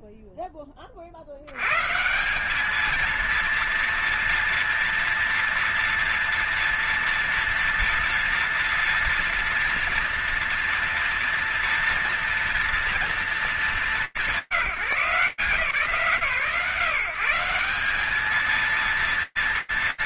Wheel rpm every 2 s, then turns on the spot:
50, 230, 230, 230, 230, 230, 190, 160, 160, 230.
none